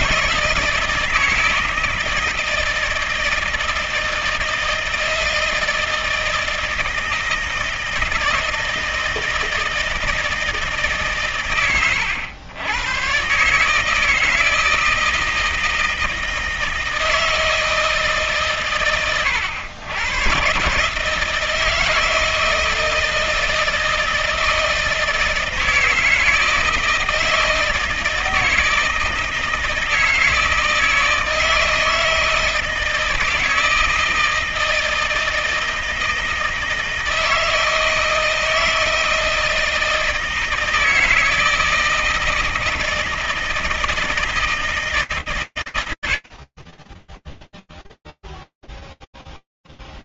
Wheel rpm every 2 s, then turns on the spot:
160, 160, 160, 160, 160, 160, 100, 160, 160, 140, 130, 160, 160, 160, 160, 160, 160, 160, 160, 160, 160, 160, 160, 40, 0.
none